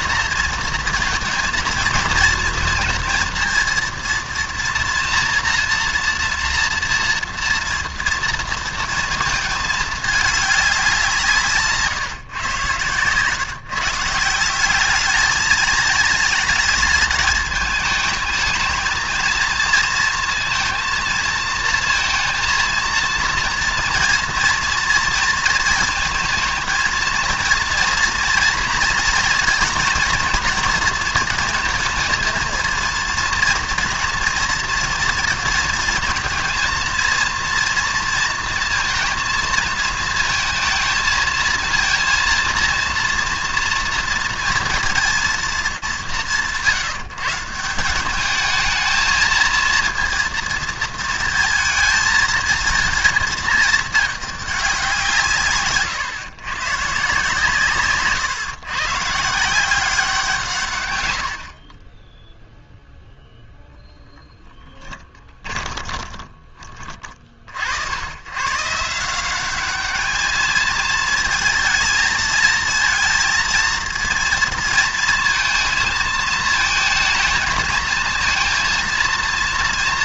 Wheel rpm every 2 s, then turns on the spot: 230, 230, 230, 230, 230, 200, 130, 190, 220, 220, 230, 230, 230, 230, 230, 230, 230, 230, 230, 230, 220, 230, 230, 150, 220, 230, 230, 190, 140, 140, 130, 0, 20, 40, 180, 230, 230, 230, 220, 230.
64-66